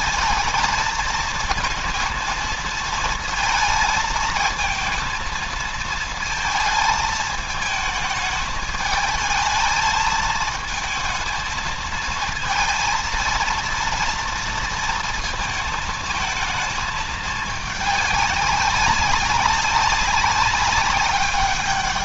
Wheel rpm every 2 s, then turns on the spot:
220, 220, 230, 220, 220, 220, 230, 230, 220, 190, 190.
none